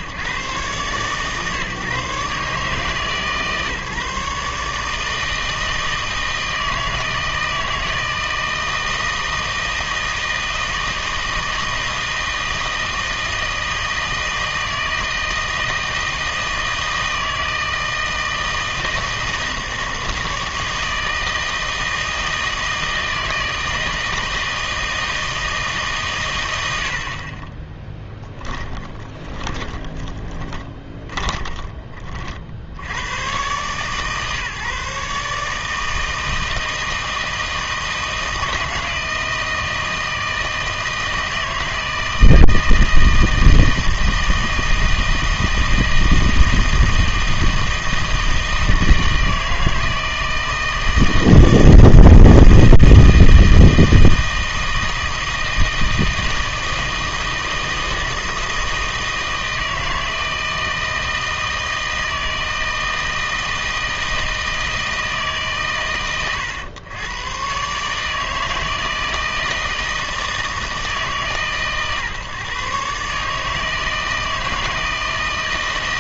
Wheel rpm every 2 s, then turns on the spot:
130, 140, 150, 160, 160, 160, 160, 160, 160, 160, 160, 160, 160, 100, 10, 20, 50, 140, 160, 160, 160, 160, 160, 160, 160, 160, 160, 160, 160, 160, 160, 160, 160, 110, 160, 160, 140, 160.
28-32